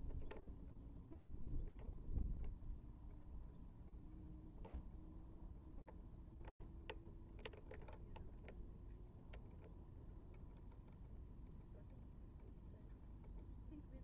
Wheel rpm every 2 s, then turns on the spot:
0, 0, 0, 0, 0, 0, 0.
none